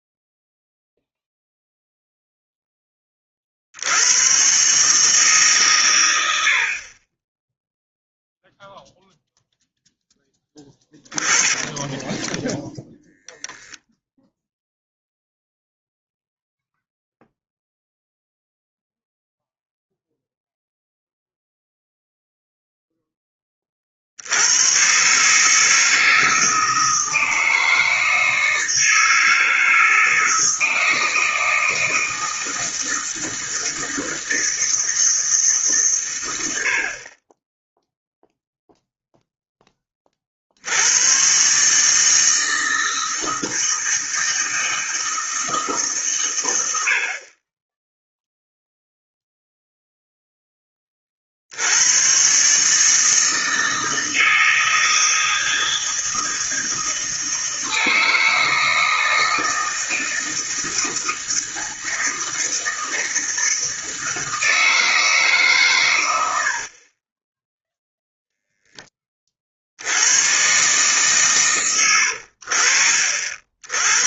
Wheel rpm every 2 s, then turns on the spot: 0, 10, 140, 50, 0, 10, 0, 0, 0, 0, 0, 0, 110, 160, 160, 160, 160, 160, 70, 0, 90, 160, 160, 80, 0, 20, 150, 160, 160, 160, 160, 160, 160, 40, 10, 130, 70.
10-12 66-68